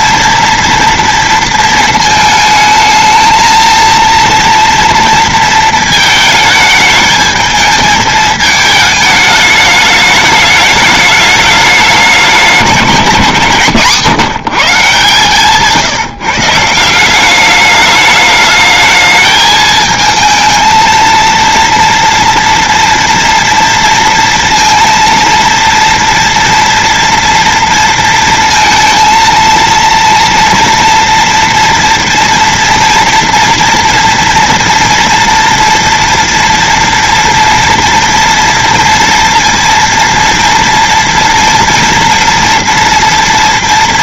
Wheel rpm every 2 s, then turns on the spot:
230, 220, 230, 220, 210, 210, 170, 150, 190, 220, 230, 230, 230, 230, 230, 230, 230, 230, 230, 230, 230, 230.
none